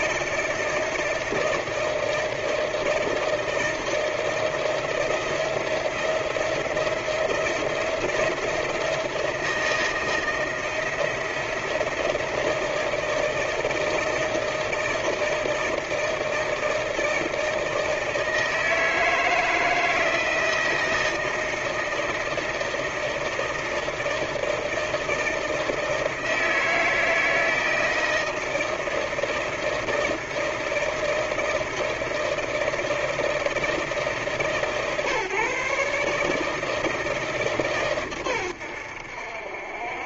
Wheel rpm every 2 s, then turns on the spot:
160, 160, 160, 170, 170, 170, 160, 160, 160, 160, 160, 160, 160, 160, 160, 160, 160, 140, 160, 90.
none